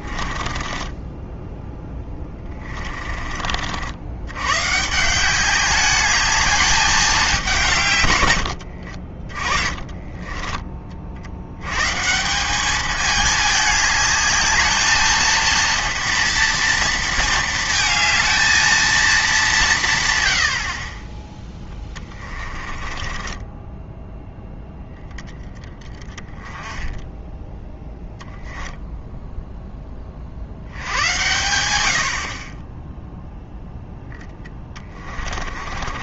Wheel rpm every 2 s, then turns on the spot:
10, 30, 150, 210, 60, 30, 210, 220, 230, 220, 40, 30, 0, 10, 0, 80, 10, 20.
0-2 8-10 22-24 34-36